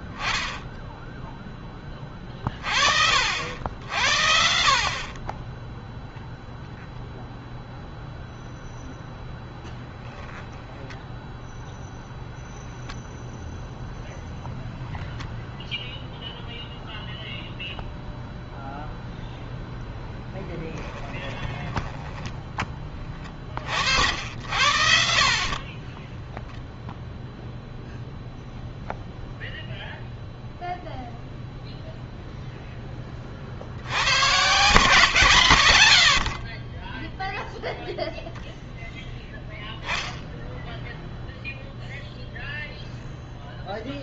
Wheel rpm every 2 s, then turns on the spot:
10, 40, 70, 0, 0, 10, 0, 0, 0, 0, 20, 20, 80, 10, 0, 0, 0, 120, 40, 0, 10, 0.
20-22